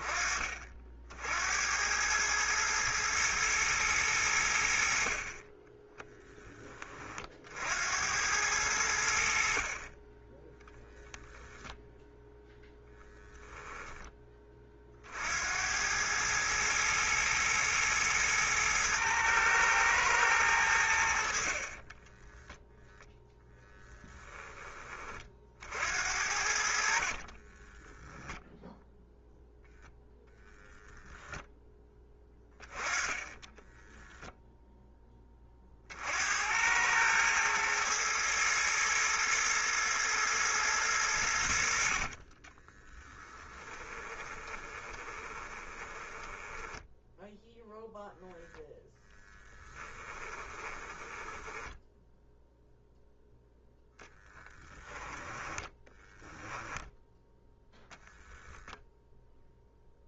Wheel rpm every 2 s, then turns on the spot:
40, 110, 80, 10, 90, 10, 0, 30, 110, 110, 90, 10, 10, 60, 0, 0, 10, 0, 90, 110, 110, 20, 20, 10, 0, 20, 0, 10, 10, 0.
42-48 50-52 54-56